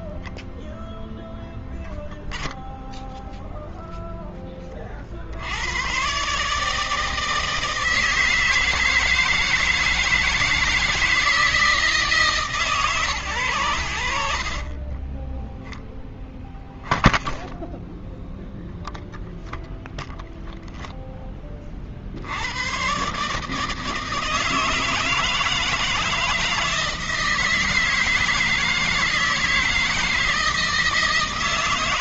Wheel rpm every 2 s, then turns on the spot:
0, 0, 20, 150, 160, 160, 160, 80, 10, 0, 0, 90, 160, 160, 160, 160.
16-18